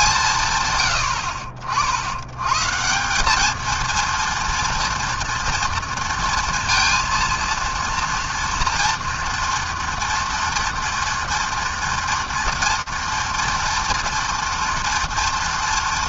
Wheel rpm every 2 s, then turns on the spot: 140, 130, 230, 230, 240, 230, 230, 230.
none